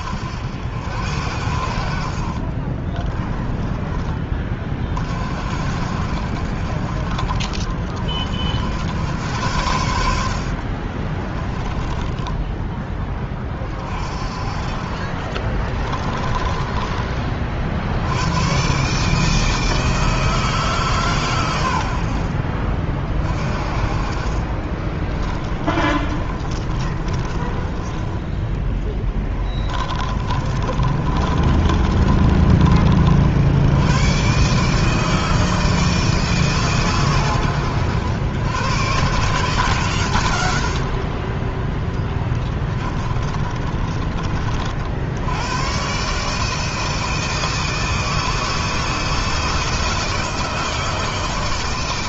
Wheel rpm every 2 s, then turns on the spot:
80, 30, 30, 50, 60, 50, 10, 40, 20, 130, 150, 50, 30, 30, 10, 30, 30, 140, 140, 110, 60, 20, 50, 160, 160, 160.
2-4 10-12 14-16 24-32 40-44